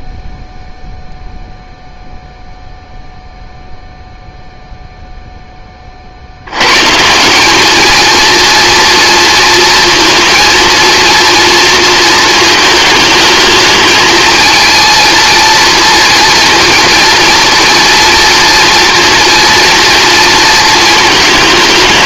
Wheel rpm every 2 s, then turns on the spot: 0, 0, 0, 110, 230, 230, 220, 230, 230, 230, 230.
none